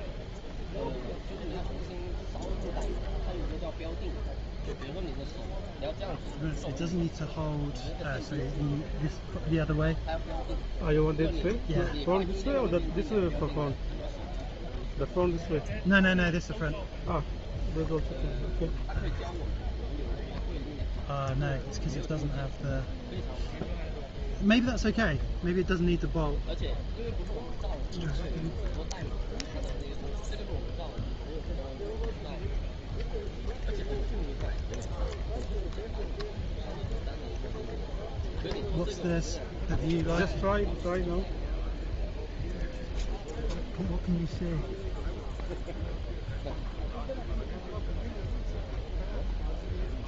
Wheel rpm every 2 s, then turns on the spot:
0, 0, 0, 0, 0, 0, 0, 0, 0, 0, 0, 0, 0, 0, 0, 0, 0, 0, 0, 0, 0, 0, 0, 0, 0.
none